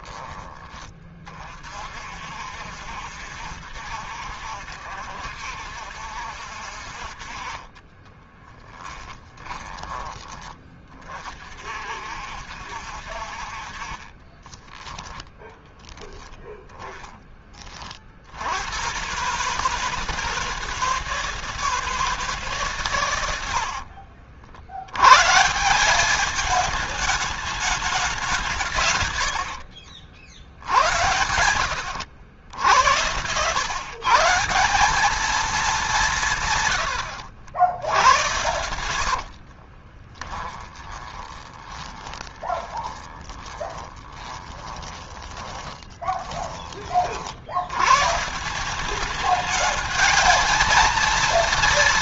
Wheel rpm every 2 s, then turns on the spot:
20, 60, 70, 50, 10, 30, 60, 20, 10, 100, 160, 130, 100, 210, 130, 90, 90, 180, 110, 90, 20, 20, 20, 30, 190, 230.
8-10 14-16 28-32 36-46